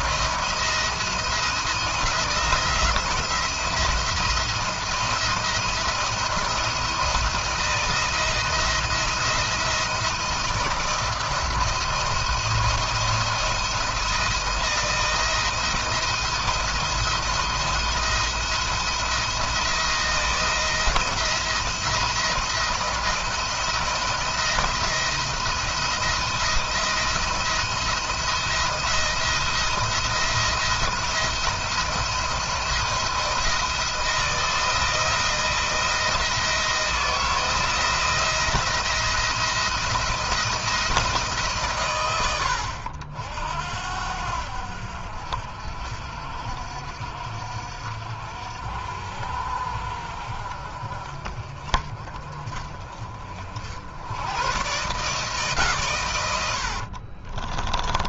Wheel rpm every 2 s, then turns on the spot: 170, 170, 170, 170, 170, 170, 170, 170, 170, 170, 170, 170, 170, 170, 160, 170, 170, 170, 160, 170, 170, 80, 70, 60, 60, 50, 40, 130, 90.
56-58